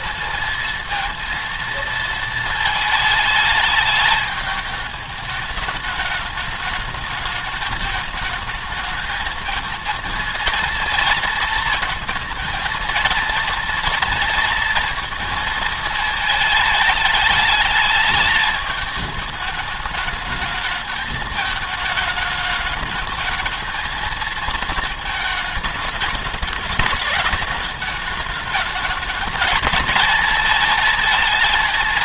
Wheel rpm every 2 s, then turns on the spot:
230, 230, 210, 210, 220, 230, 230, 230, 220, 210, 220, 210, 220, 210, 210, 220.
none